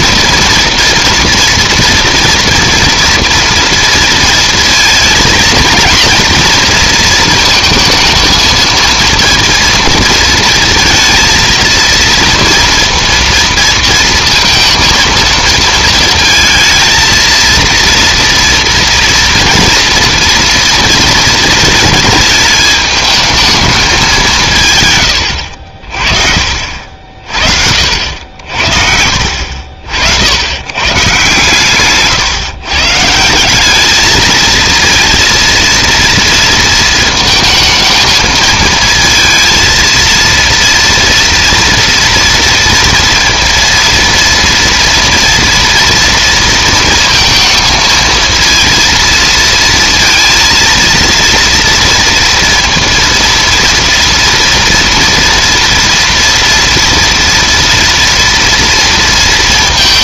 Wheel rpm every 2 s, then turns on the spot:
230, 230, 220, 230, 230, 230, 230, 230, 230, 230, 230, 220, 120, 60, 60, 110, 130, 230, 230, 230, 230, 230, 230, 230, 230, 230, 230, 230, 230, 230.
none